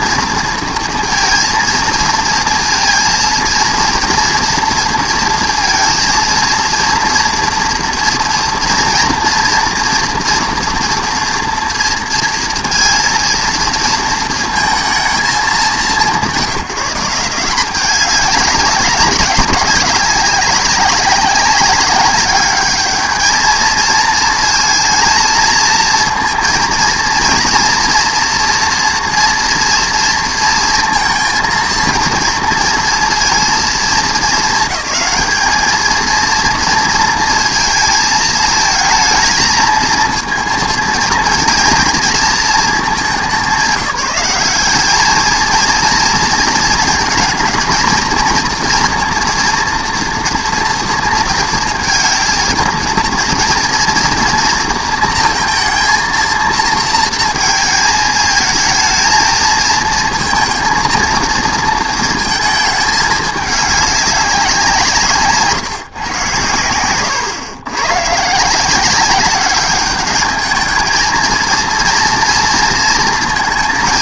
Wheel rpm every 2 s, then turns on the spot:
230, 230, 230, 230, 240, 240, 230, 220, 170, 200, 200, 210, 230, 230, 230, 230, 230, 220, 230, 220, 230, 210, 200, 230, 230, 230, 230, 230, 230, 220, 230, 220, 170, 100, 170, 220, 230.
66-68